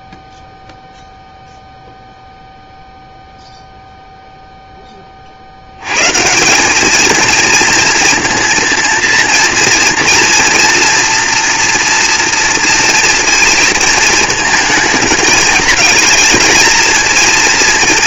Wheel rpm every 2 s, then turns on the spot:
0, 0, 50, 230, 230, 230, 230, 210, 230.
none